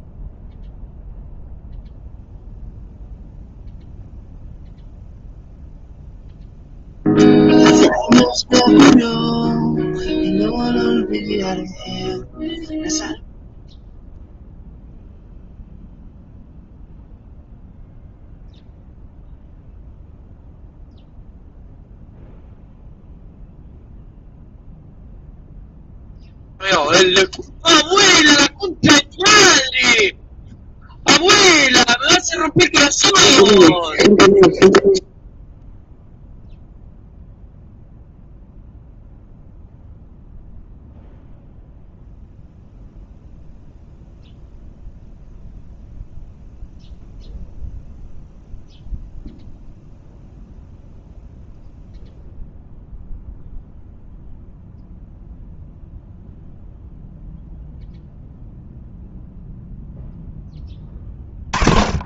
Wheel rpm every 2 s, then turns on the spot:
0, 0, 0, 0, 0, 0, 0, 0, 0, 0, 0, 0, 0, 0, 0, 0, 0, 0, 0, 0, 0, 0, 0, 0, 0, 0, 0, 0, 0, 0, 10.
none